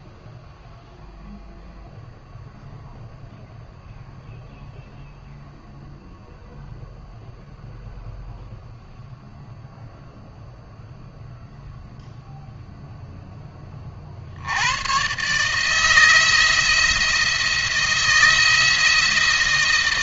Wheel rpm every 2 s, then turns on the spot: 0, 0, 0, 0, 0, 0, 40, 160, 160, 160.
none